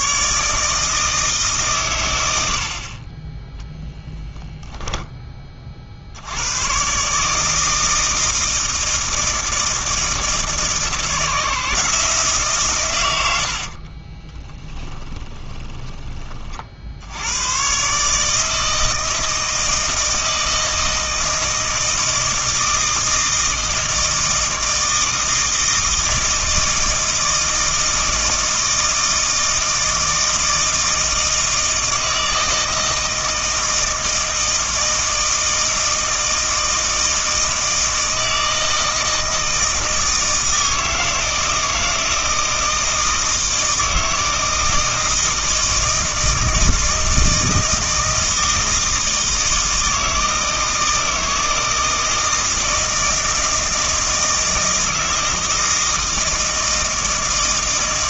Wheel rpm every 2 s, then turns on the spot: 150, 70, 20, 110, 160, 160, 130, 20, 50, 160, 160, 160, 160, 160, 160, 160, 160, 160, 160, 160, 160, 160, 160, 160, 160, 160, 160, 160, 160.
14-16